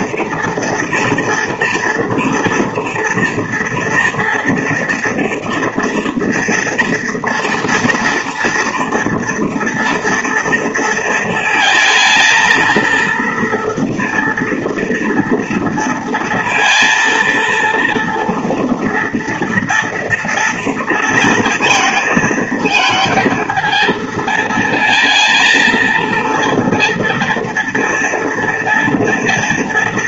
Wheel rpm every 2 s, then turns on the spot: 230, 230, 230, 230, 230, 230, 230, 230, 230, 230, 230, 220, 230, 230, 230.
none